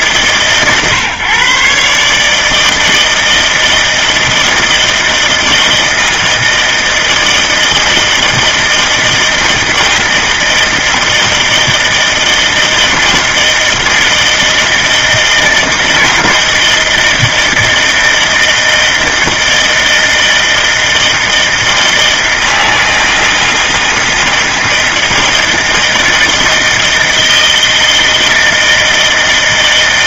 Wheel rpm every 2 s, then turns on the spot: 130, 160, 160, 160, 160, 160, 160, 160, 160, 160, 160, 160, 160, 160, 160.
none